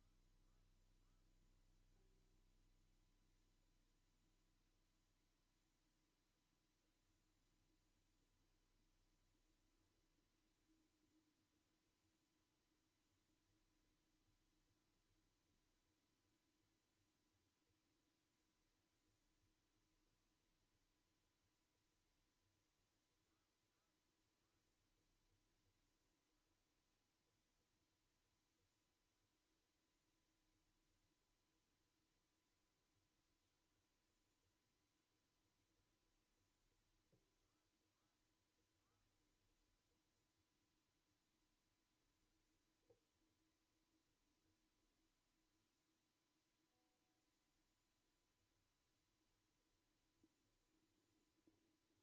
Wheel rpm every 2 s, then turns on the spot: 0, 0, 0, 0, 0, 0, 0, 0, 0, 0, 0, 0, 0, 0, 0, 0, 0, 0, 0, 0, 0, 0, 0, 0, 0, 0.
none